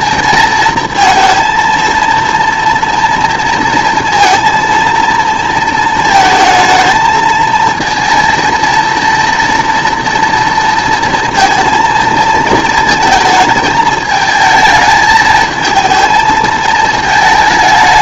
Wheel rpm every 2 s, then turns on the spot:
230, 230, 230, 220, 230, 230, 230, 220, 220.
none